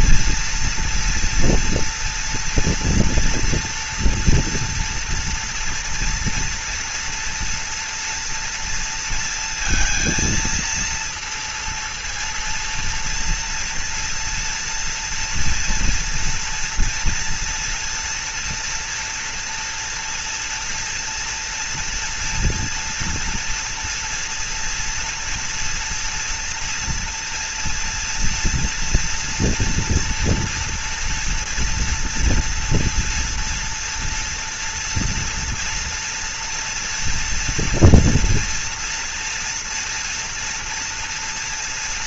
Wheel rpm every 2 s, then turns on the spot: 230, 230, 230, 230, 230, 230, 230, 230, 230, 230, 240, 240, 240, 230, 230, 230, 230, 230, 230, 230, 230.
none